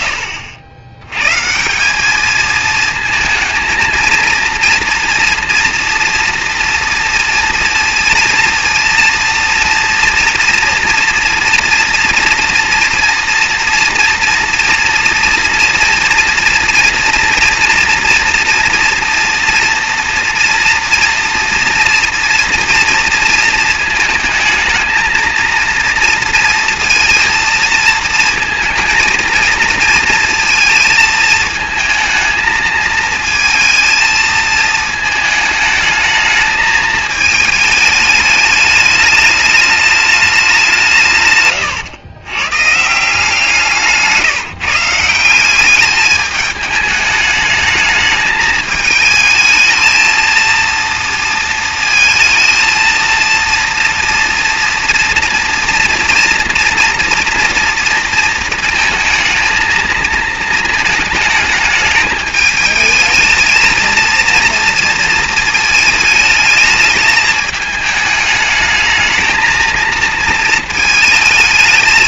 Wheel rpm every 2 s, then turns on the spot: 90, 220, 230, 230, 230, 240, 230, 230, 230, 230, 230, 230, 230, 230, 220, 220, 220, 220, 220, 210, 140, 170, 170, 210, 220, 230, 230, 230, 230, 220, 220, 220, 230, 220, 220, 220.
none